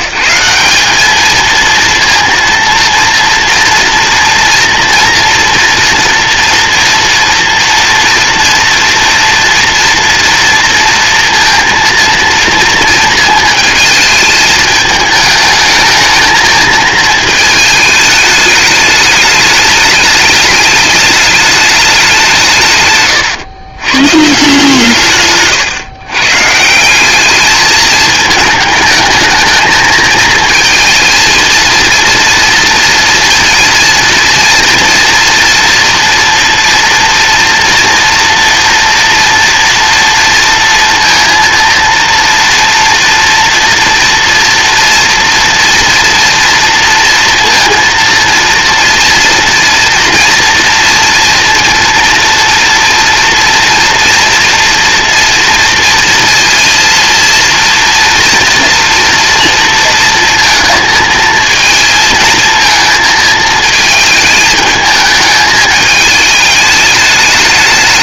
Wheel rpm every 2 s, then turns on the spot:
200, 230, 230, 230, 230, 230, 230, 220, 220, 210, 210, 130, 160, 180, 220, 230, 240, 230, 240, 240, 230, 230, 230, 230, 230, 240, 230, 230, 230, 230, 230, 230, 210, 210.
none